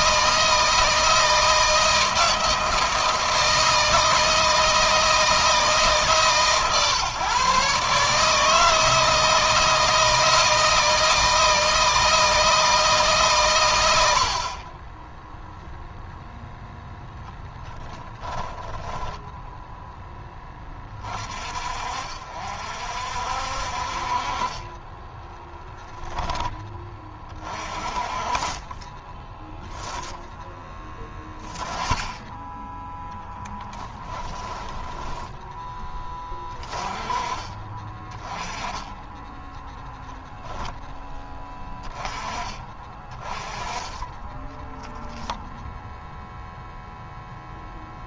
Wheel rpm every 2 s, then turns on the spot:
160, 160, 160, 150, 150, 160, 160, 60, 0, 10, 20, 50, 40, 10, 30, 0, 0, 10, 20, 20, 10, 20, 10, 0.
18-20 34-36 44-46